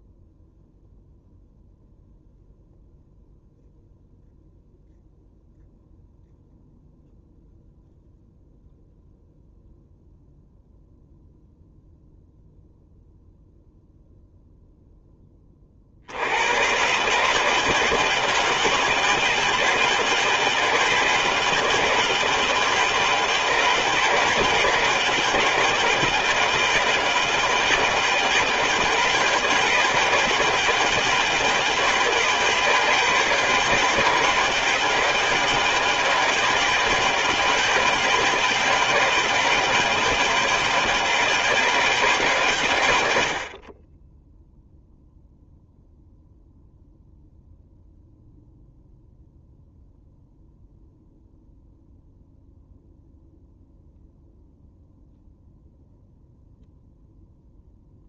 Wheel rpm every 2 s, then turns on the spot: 0, 0, 0, 0, 0, 0, 0, 10, 140, 160, 160, 160, 170, 160, 160, 160, 160, 160, 160, 160, 160, 100, 0, 0, 0, 0, 0, 0, 0.
none